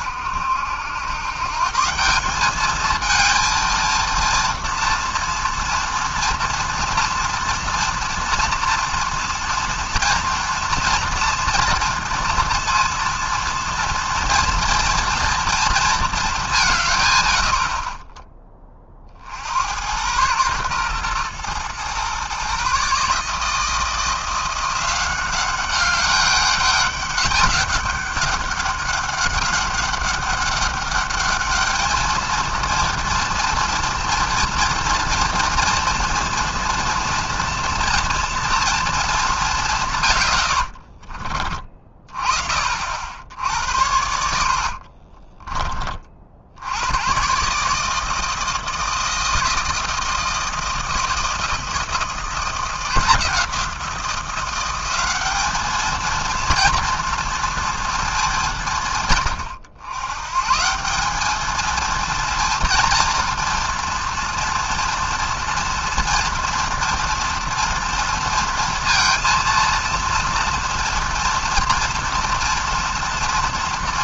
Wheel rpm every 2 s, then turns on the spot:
90, 210, 230, 230, 230, 240, 230, 230, 160, 30, 120, 140, 180, 200, 200, 200, 230, 230, 230, 230, 70, 60, 50, 90, 160, 160, 170, 190, 230, 150, 170, 230, 230, 230, 230, 230, 230.
40-42 44-46